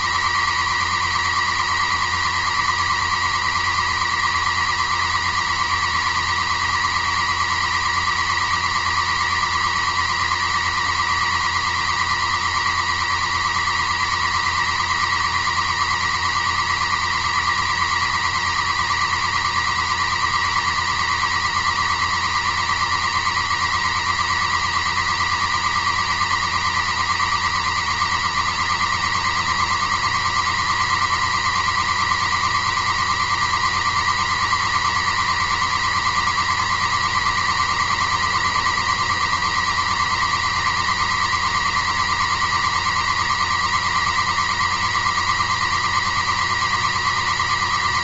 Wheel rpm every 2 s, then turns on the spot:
130, 130, 130, 130, 130, 130, 130, 130, 130, 130, 130, 130, 130, 130, 130, 130, 130, 130, 130, 130, 130, 130, 130, 130.
none